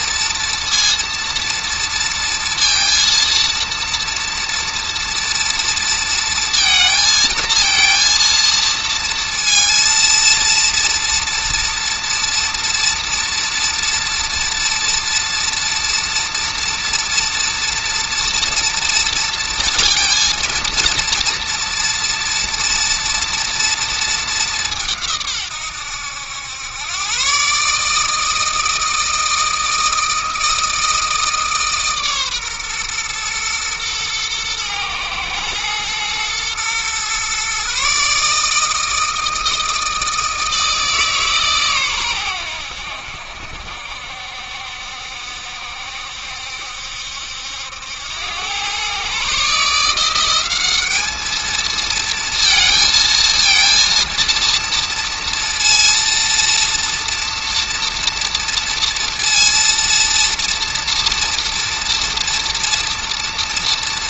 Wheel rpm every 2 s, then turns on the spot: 230, 230, 230, 230, 230, 230, 230, 230, 230, 230, 230, 240, 170, 110, 160, 160, 120, 120, 120, 160, 160, 80, 70, 70, 120, 210, 220, 230, 230, 230, 230, 230.
none